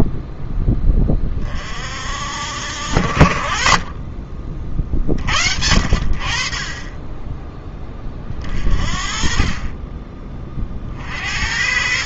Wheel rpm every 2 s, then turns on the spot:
20, 60, 40, 20, 40, 40.
none